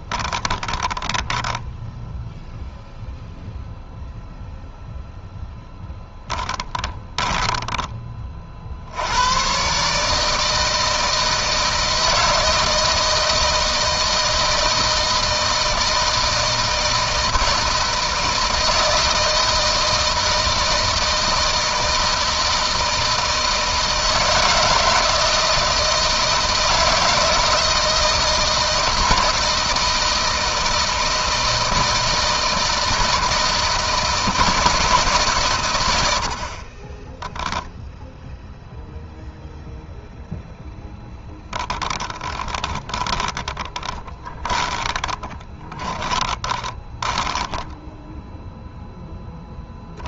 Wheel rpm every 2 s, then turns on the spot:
20, 0, 0, 10, 60, 160, 160, 160, 160, 160, 160, 160, 160, 160, 170, 160, 160, 160, 40, 0, 10, 20, 10, 10, 0.
0-2 6-8 36-38 42-48